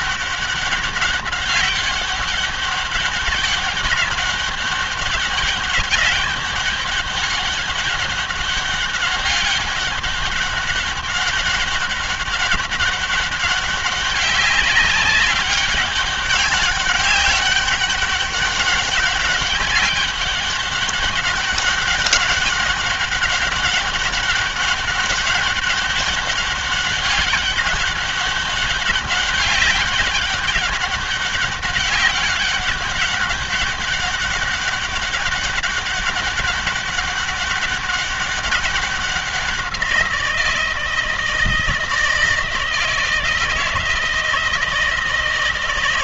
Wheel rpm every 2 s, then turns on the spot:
200, 200, 200, 200, 200, 200, 200, 190, 200, 200, 200, 200, 200, 200, 200, 200, 200, 200, 200, 190, 160, 160, 160.
none